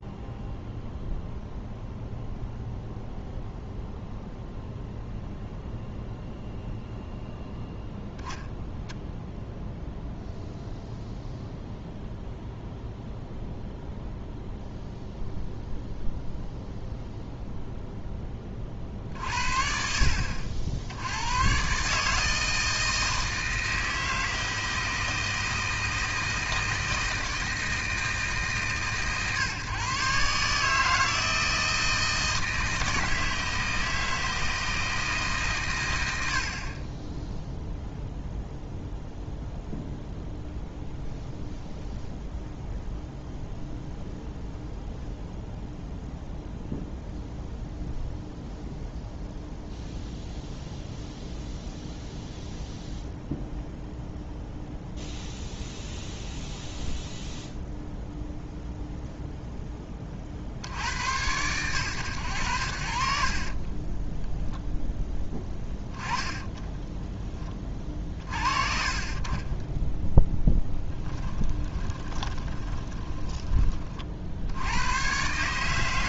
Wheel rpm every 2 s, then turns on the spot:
0, 0, 0, 0, 0, 0, 0, 0, 0, 40, 70, 160, 160, 160, 130, 150, 160, 160, 30, 0, 0, 0, 0, 0, 0, 0, 0, 0, 0, 0, 80, 70, 0, 10, 40, 10, 30, 90.
18-20 66-68 70-74